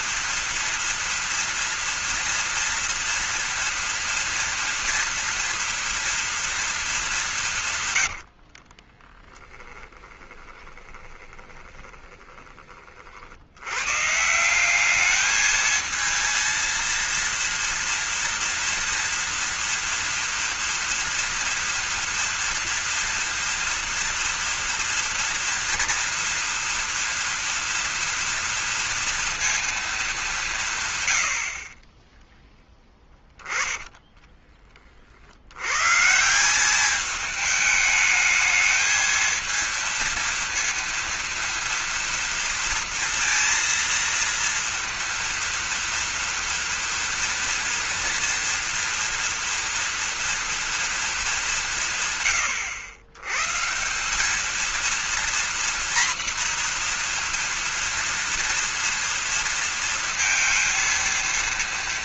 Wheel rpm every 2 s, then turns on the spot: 230, 230, 230, 230, 50, 20, 20, 170, 230, 230, 230, 230, 230, 230, 230, 180, 10, 30, 190, 220, 230, 230, 230, 230, 230, 230, 100, 220, 240, 230, 230.
8-12